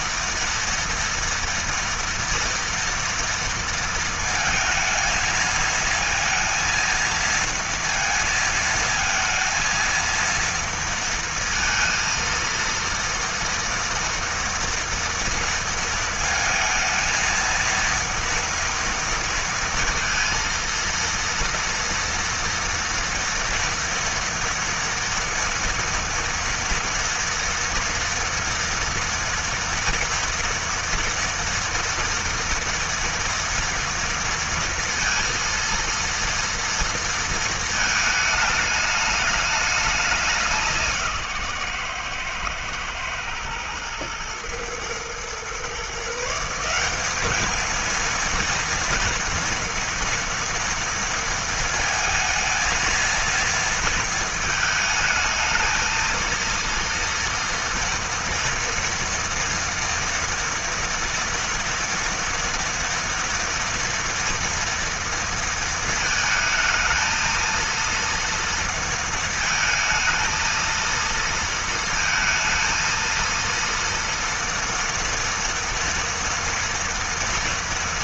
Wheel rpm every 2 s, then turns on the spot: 230, 230, 220, 230, 230, 230, 230, 230, 230, 230, 230, 230, 230, 230, 230, 230, 240, 230, 230, 210, 160, 120, 120, 200, 230, 230, 230, 220, 230, 230, 240, 230, 230, 220, 230, 230, 230, 230, 230.
none